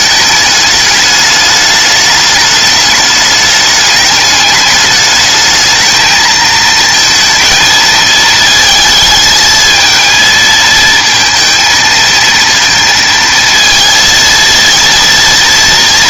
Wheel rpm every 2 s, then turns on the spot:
210, 210, 210, 230, 220, 230, 230, 230.
none